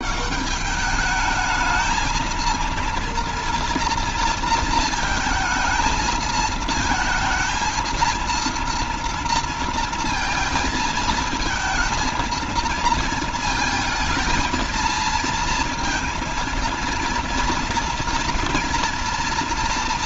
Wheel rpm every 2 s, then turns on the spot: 210, 230, 230, 220, 230, 230, 220, 230, 230, 230.
none